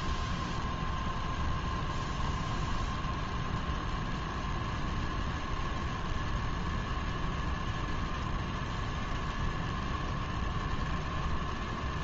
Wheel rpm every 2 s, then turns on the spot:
0, 0, 0, 0, 10, 0.
none